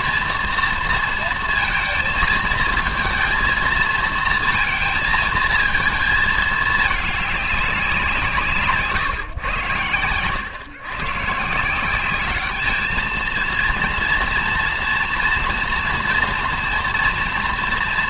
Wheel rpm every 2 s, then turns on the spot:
230, 230, 220, 210, 150, 120, 220, 230, 240.
8-10